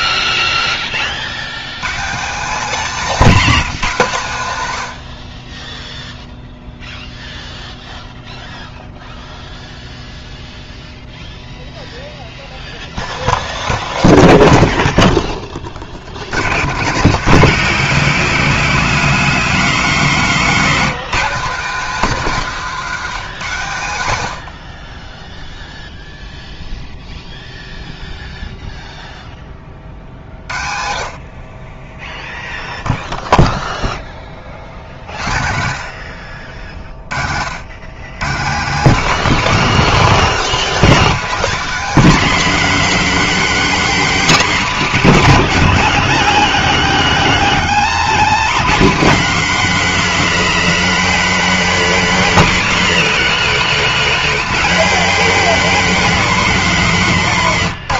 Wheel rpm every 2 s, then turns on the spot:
0, 200, 120, 0, 0, 0, 0, 10, 110, 200, 210, 220, 80, 0, 0, 50, 0, 50, 50, 160, 210, 230, 180, 110, 150, 230, 170, 180, 220.
14-16